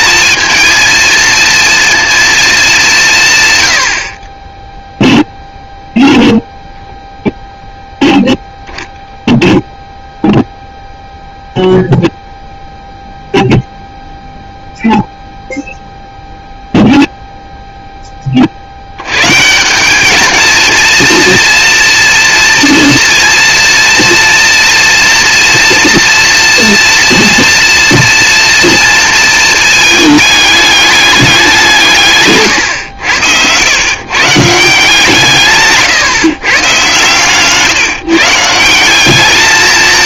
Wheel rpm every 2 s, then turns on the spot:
230, 220, 0, 0, 0, 0, 0, 0, 0, 50, 220, 230, 230, 230, 240, 210, 130, 170, 130, 160.
none